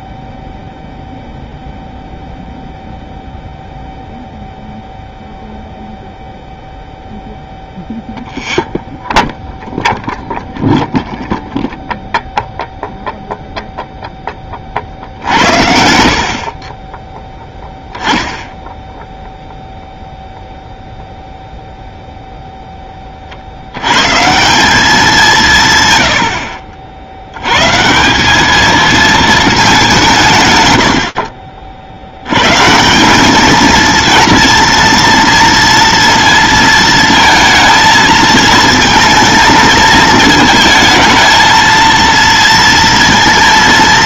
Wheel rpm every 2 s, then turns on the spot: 0, 0, 0, 0, 0, 0, 0, 30, 30, 0, 0, 10, 180, 70, 220, 110, 160, 230, 230, 230, 220, 230.
none